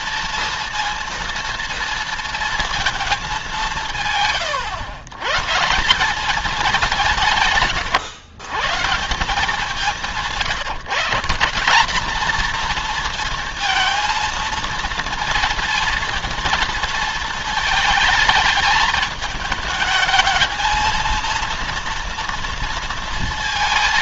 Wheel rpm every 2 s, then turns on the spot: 230, 220, 120, 200, 160, 140, 230, 230, 230, 220, 230, 230.
none